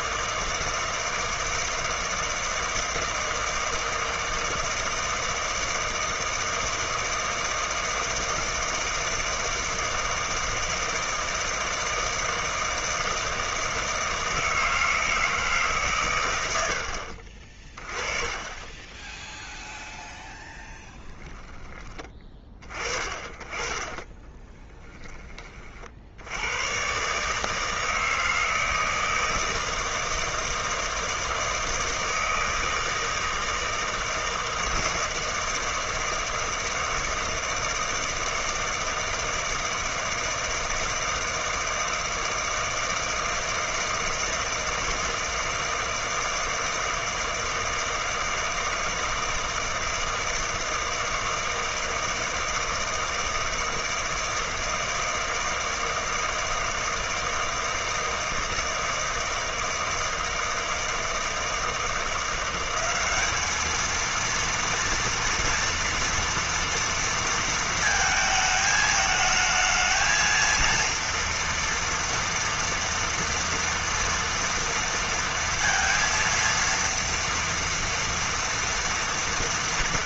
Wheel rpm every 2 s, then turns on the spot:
160, 160, 160, 160, 160, 160, 160, 160, 90, 20, 0, 20, 10, 110, 160, 160, 160, 160, 160, 160, 160, 160, 160, 160, 160, 160, 160, 160, 160, 160, 160, 190, 230, 230, 220, 230, 230, 230, 230, 230.
none